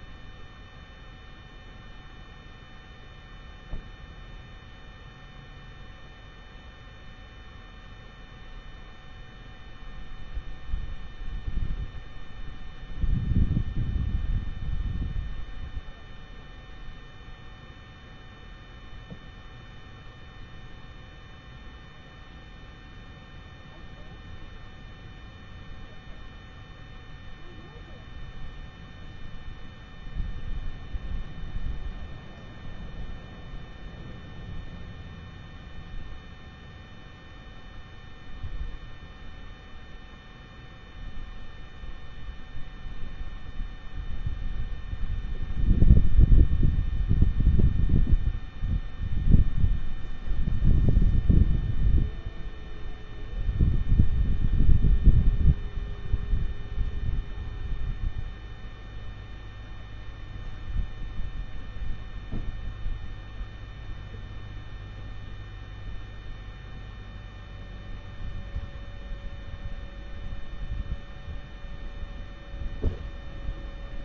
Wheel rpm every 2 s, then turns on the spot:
0, 0, 0, 0, 0, 0, 0, 0, 0, 0, 0, 0, 0, 0, 0, 0, 0, 0, 0, 0, 0, 0, 0, 0, 0, 0, 0, 0, 0, 0, 0, 0, 0, 0, 0, 0, 0.
none